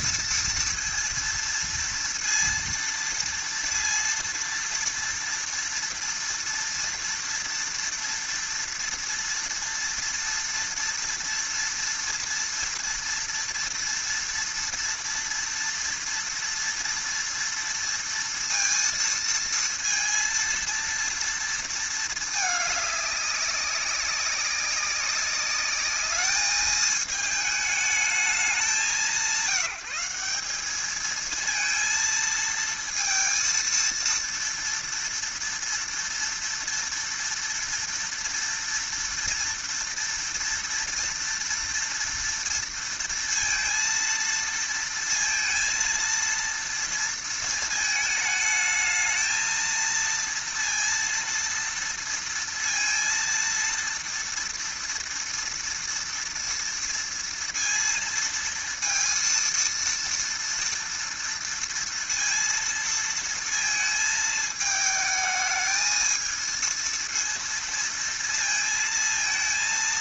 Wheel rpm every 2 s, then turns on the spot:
230, 230, 230, 230, 230, 230, 230, 230, 230, 230, 230, 210, 200, 220, 170, 220, 230, 230, 230, 230, 230, 230, 230, 230, 220, 230, 230, 230, 230, 230, 230, 230, 220, 230, 230.
none